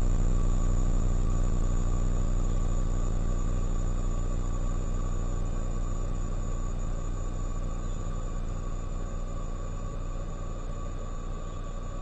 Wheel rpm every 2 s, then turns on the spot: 0, 0, 0, 0, 0, 0.
none